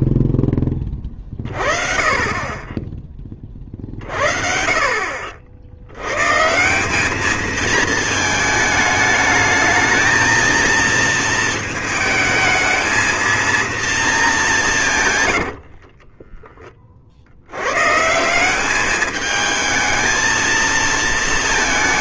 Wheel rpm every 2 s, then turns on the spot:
30, 20, 70, 220, 220, 220, 230, 100, 90, 220, 220.
14-16